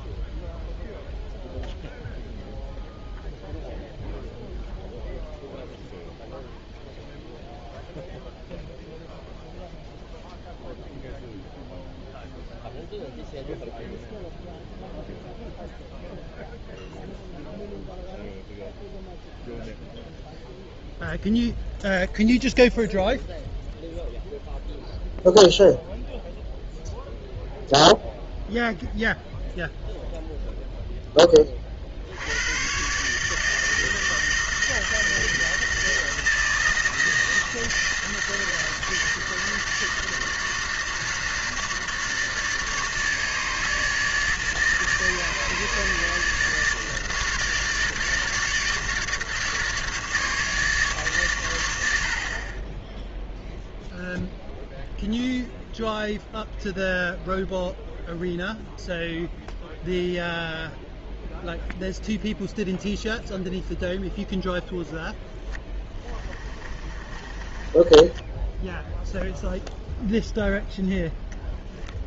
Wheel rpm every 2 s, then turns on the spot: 0, 0, 0, 0, 0, 0, 0, 0, 0, 0, 0, 0, 0, 0, 0, 0, 110, 160, 160, 160, 160, 150, 150, 160, 150, 150, 30, 0, 0, 0, 0, 0, 0, 20, 10, 0.
66-70